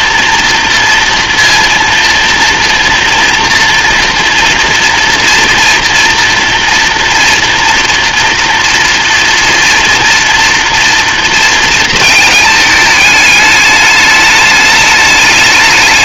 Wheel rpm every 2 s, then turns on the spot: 230, 230, 240, 230, 230, 230, 220, 210.
none